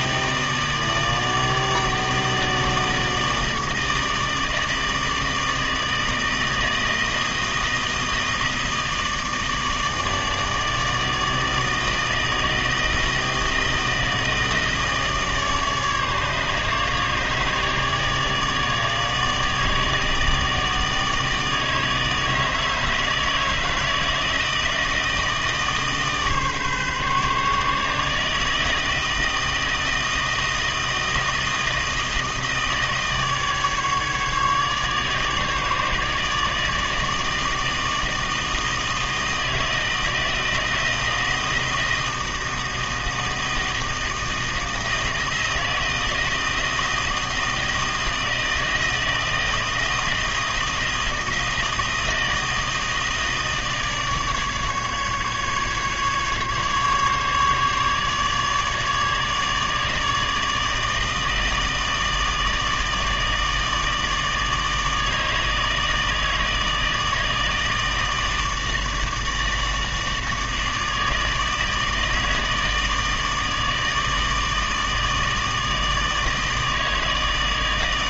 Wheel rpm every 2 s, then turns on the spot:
160, 160, 160, 160, 160, 150, 160, 160, 150, 150, 160, 160, 160, 150, 160, 160, 160, 150, 150, 160, 160, 160, 160, 160, 160, 160, 160, 150, 140, 150, 160, 160, 160, 160, 160, 160, 160, 160, 160.
none